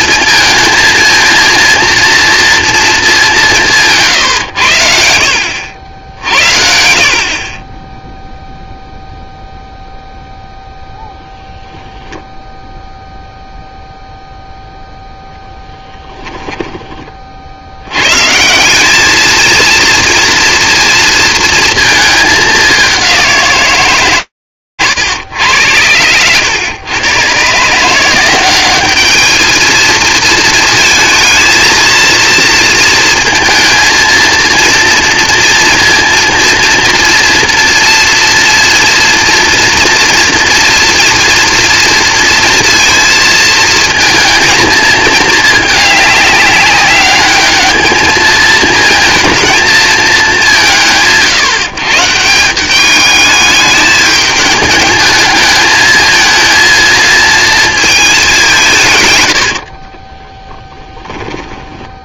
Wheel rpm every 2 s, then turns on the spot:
230, 230, 110, 70, 0, 0, 0, 0, 10, 180, 230, 200, 160, 100, 140, 220, 230, 230, 230, 240, 230, 230, 230, 210, 210, 220, 140, 210, 220, 230, 60.
60-62